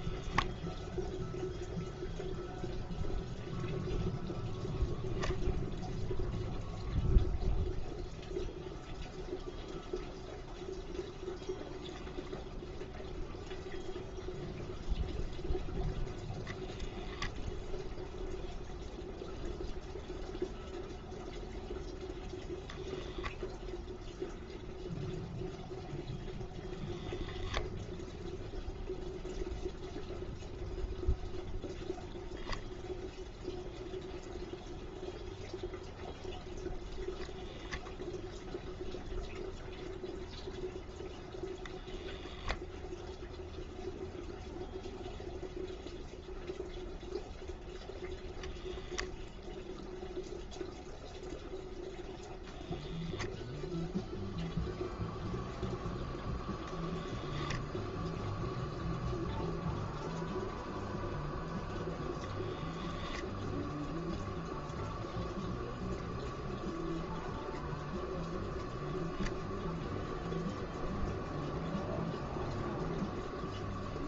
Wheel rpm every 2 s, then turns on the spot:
0, 0, 0, 0, 0, 0, 0, 0, 0, 0, 0, 0, 0, 0, 0, 0, 0, 0, 0, 0, 0, 0, 0, 0, 0, 0, 0, 0, 0, 0, 0, 0, 0, 0, 0, 0, 0.
none